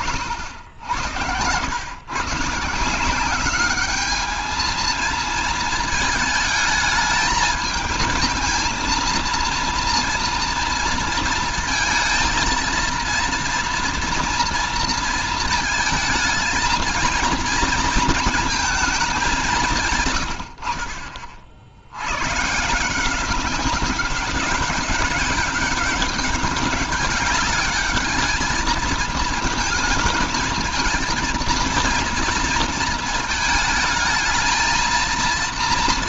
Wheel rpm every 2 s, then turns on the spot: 80, 170, 220, 220, 230, 230, 230, 230, 220, 220, 60, 160, 200, 200, 220, 220, 230, 230.
none